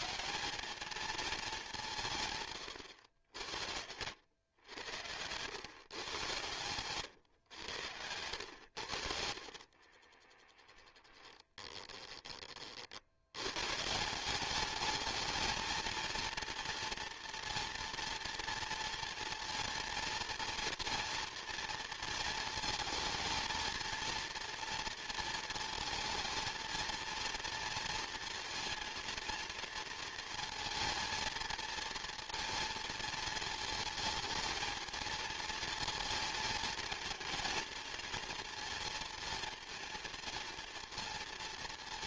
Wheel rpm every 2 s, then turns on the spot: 210, 120, 100, 110, 90, 10, 50, 210, 230, 230, 230, 220, 230, 230, 230, 220, 230, 220, 220, 230, 230.
10-12